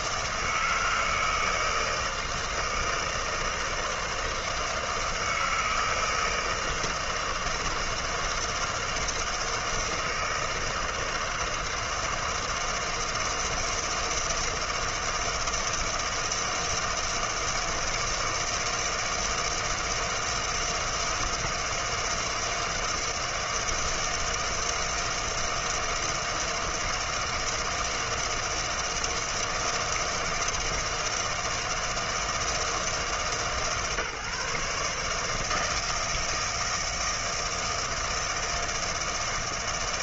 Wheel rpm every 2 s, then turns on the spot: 160, 160, 160, 160, 160, 160, 160, 160, 160, 160, 160, 160, 160, 160, 160, 160, 160, 140, 160, 160.
none